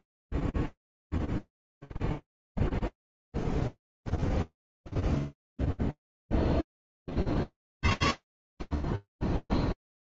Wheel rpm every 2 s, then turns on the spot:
0, 0, 0, 30, 10.
none